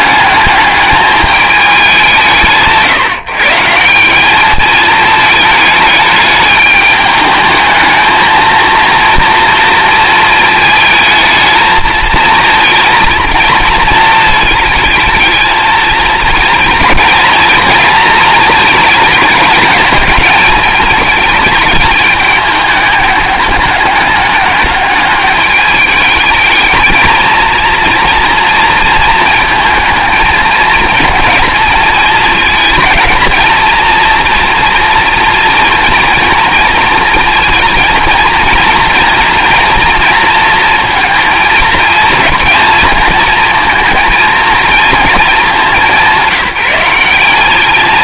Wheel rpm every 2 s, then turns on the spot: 210, 160, 210, 210, 230, 220, 220, 220, 220, 220, 220, 210, 200, 220, 230, 220, 220, 230, 230, 230, 230, 220, 230, 190.
none